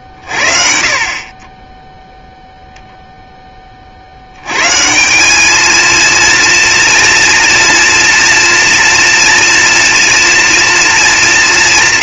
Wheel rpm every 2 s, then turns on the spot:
30, 0, 180, 230, 230, 220.
none